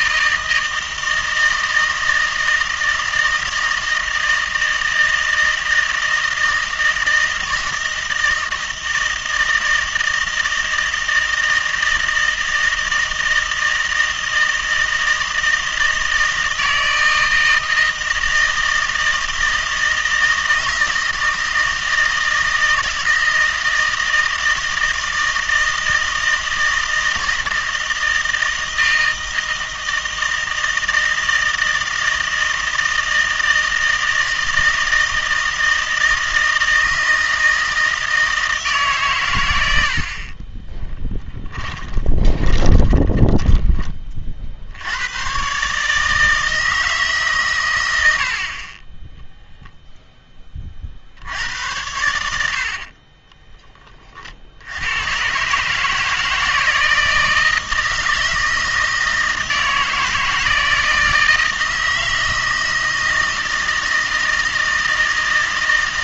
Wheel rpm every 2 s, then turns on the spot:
160, 160, 160, 160, 160, 160, 160, 160, 160, 160, 160, 160, 160, 160, 160, 160, 160, 160, 160, 150, 30, 20, 60, 160, 40, 30, 60, 70, 160, 160, 160, 160, 160.
40-44 52-54